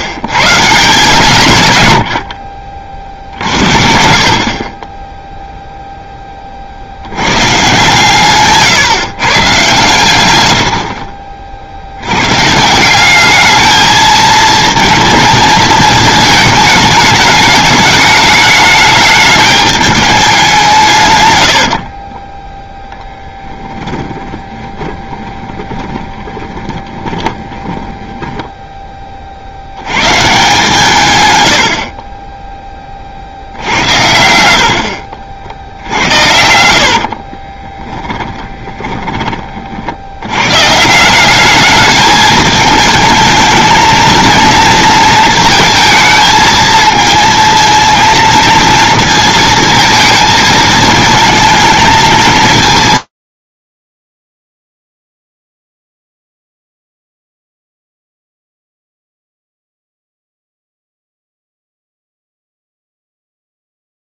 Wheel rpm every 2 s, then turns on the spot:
150, 50, 30, 60, 140, 90, 160, 230, 220, 210, 160, 0, 20, 20, 20, 150, 20, 60, 60, 20, 150, 220, 230, 220, 230, 220, 170, 30, 40, 10, 10, 0.
24-28 34-40